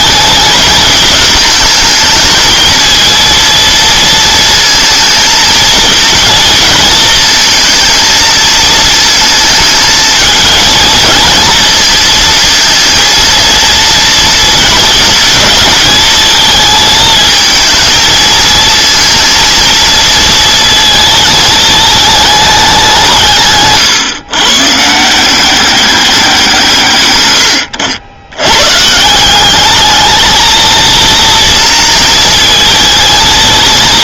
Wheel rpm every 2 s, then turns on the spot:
220, 220, 230, 230, 220, 220, 230, 220, 220, 220, 230, 200, 130, 170, 120, 220, 230.
none